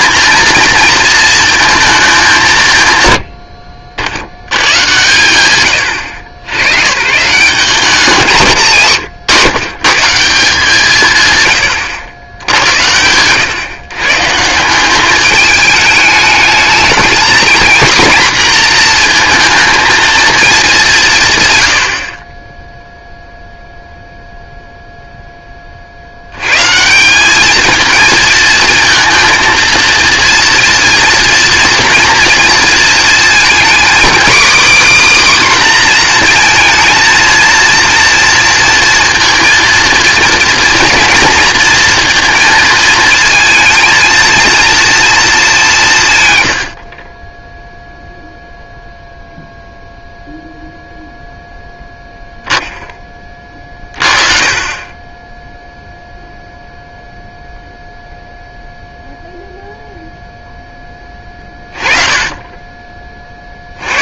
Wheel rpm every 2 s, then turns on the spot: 230, 120, 110, 110, 150, 160, 80, 170, 230, 240, 190, 0, 0, 140, 230, 230, 230, 280, 230, 230, 230, 230, 230, 60, 0, 0, 10, 30, 0, 0, 10, 20.
none